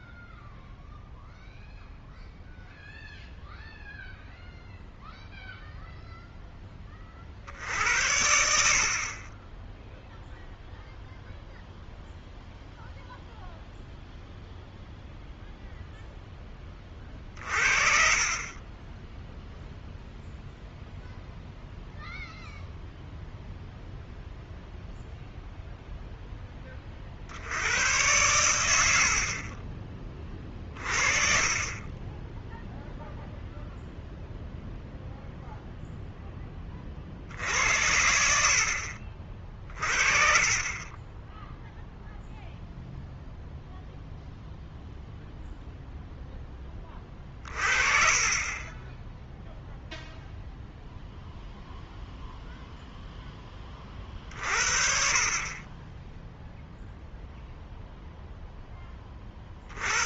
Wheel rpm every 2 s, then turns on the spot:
0, 0, 0, 10, 60, 0, 0, 0, 20, 20, 0, 0, 0, 20, 90, 30, 0, 0, 20, 60, 30, 0, 0, 20, 20, 0, 0, 40, 0, 10.
none